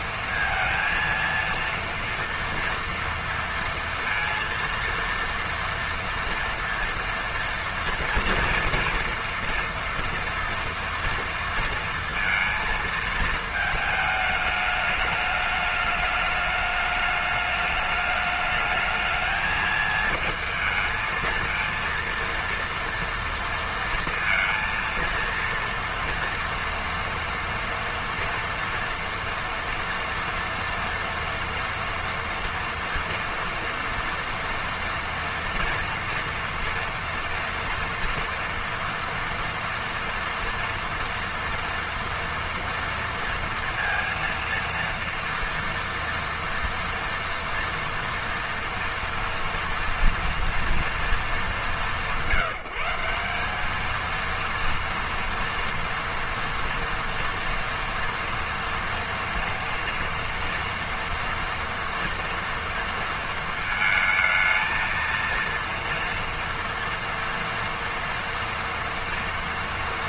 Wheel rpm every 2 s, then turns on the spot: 230, 230, 230, 230, 240, 230, 220, 210, 210, 220, 220, 230, 230, 230, 230, 240, 230, 230, 230, 230, 230, 230, 230, 230, 230, 220, 170, 240, 230, 230, 230, 230, 220, 230, 230.
none